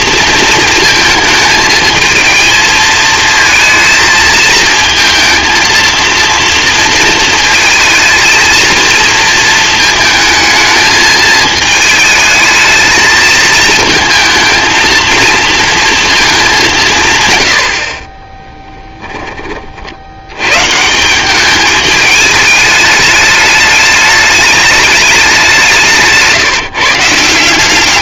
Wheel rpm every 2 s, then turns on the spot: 220, 220, 220, 230, 230, 220, 220, 230, 190, 10, 130, 210, 210, 160.
18-20